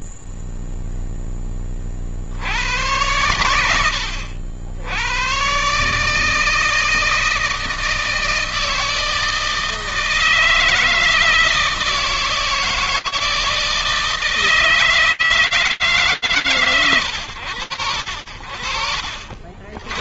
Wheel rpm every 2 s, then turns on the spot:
0, 20, 100, 130, 160, 160, 160, 160, 130, 50.
none